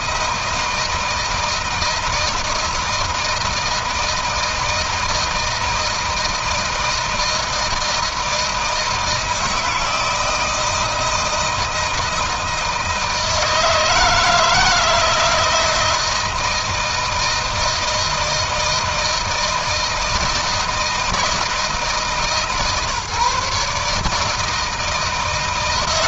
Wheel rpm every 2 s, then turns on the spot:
160, 160, 160, 160, 160, 160, 160, 160, 160, 160, 160, 150, 160.
none